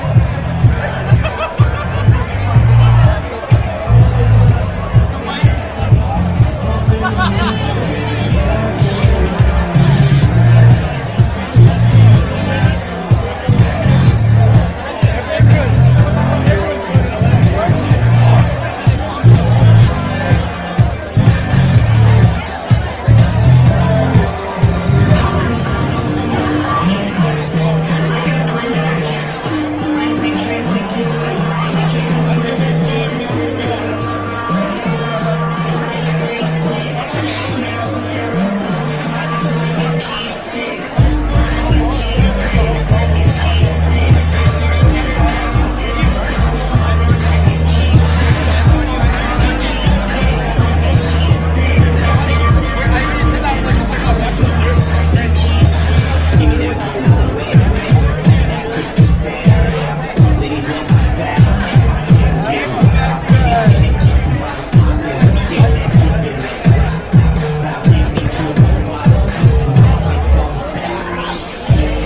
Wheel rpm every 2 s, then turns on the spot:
0, 0, 0, 0, 0, 0, 0, 0, 0, 0, 0, 0, 0, 0, 0, 0, 0, 0, 0, 0, 0, 0, 0, 0, 0, 0, 0, 0, 0, 0, 0, 0, 0, 0, 0, 0.
none